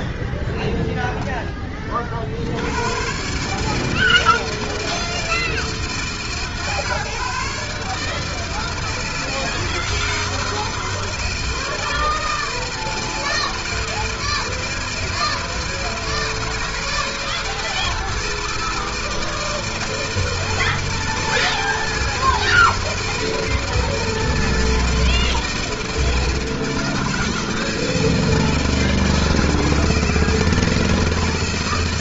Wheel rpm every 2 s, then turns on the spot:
30, 160, 150, 150, 160, 160, 160, 160, 160, 160, 160, 160, 160, 160, 160, 160.
none